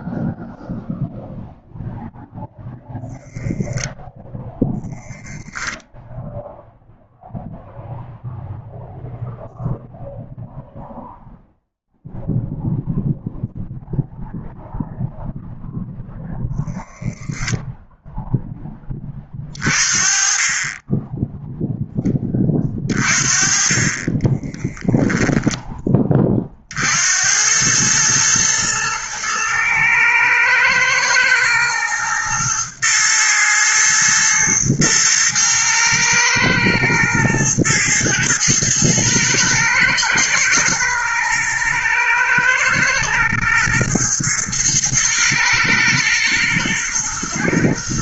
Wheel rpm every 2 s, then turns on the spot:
0, 0, 0, 0, 0, 0, 0, 0, 0, 20, 20, 30, 10, 60, 110, 110, 110, 110, 110, 110, 110, 110, 110, 110.
none